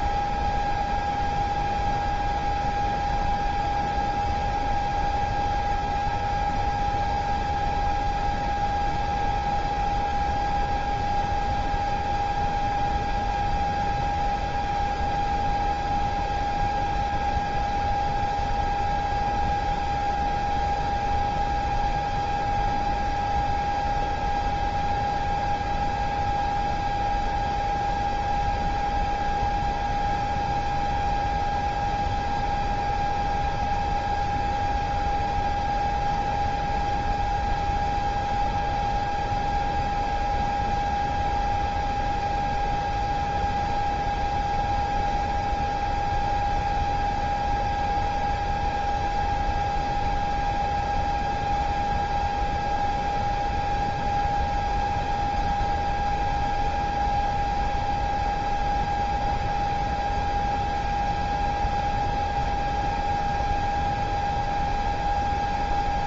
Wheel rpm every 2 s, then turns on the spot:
0, 0, 0, 0, 0, 0, 0, 0, 0, 0, 0, 0, 0, 0, 0, 0, 0, 0, 0, 0, 0, 0, 0, 0, 0, 0, 0, 0, 0, 0, 0, 0, 0.
none